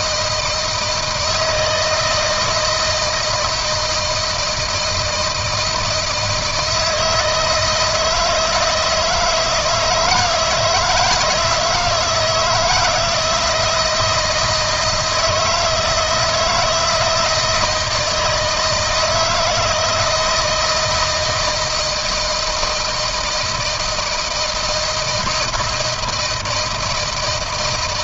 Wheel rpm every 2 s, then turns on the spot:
160, 160, 160, 160, 160, 160, 160, 170, 170, 160, 160, 160, 160, 160.
none